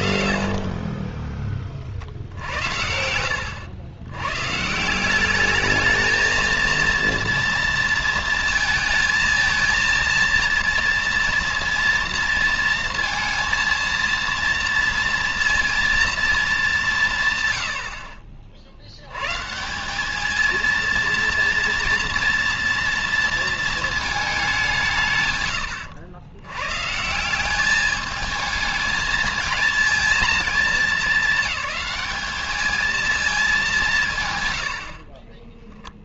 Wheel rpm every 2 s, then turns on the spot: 60, 90, 220, 230, 230, 230, 230, 230, 110, 170, 230, 230, 100, 200, 230, 210, 190, 30.
0-2